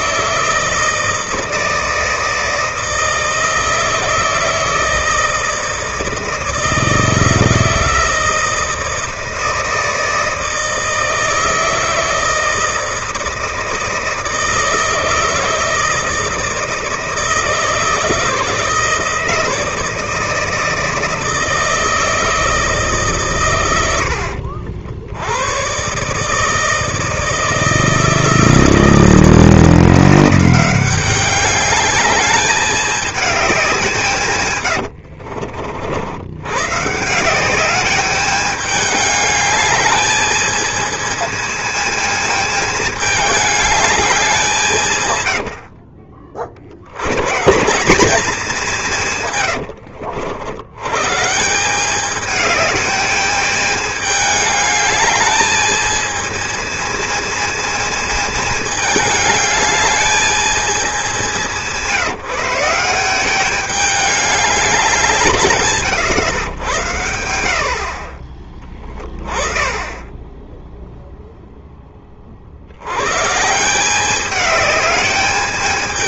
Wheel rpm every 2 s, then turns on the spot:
160, 160, 160, 160, 160, 160, 160, 160, 160, 160, 160, 160, 70, 150, 160, 180, 210, 130, 120, 210, 220, 220, 180, 50, 180, 100, 210, 210, 230, 220, 220, 170, 200, 120, 20, 0, 70, 210.
34-36